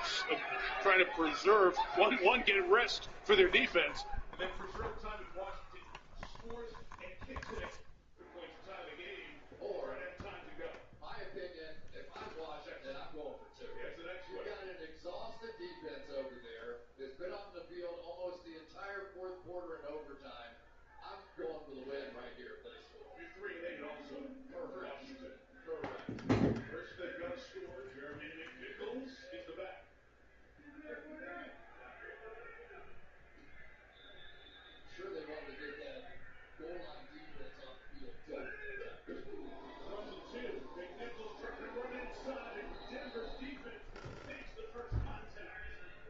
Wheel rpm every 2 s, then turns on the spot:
0, 0, 0, 0, 0, 0, 0, 0, 0, 0, 0, 0, 0, 0, 0, 0, 0, 0, 0, 0, 0, 0, 0.
none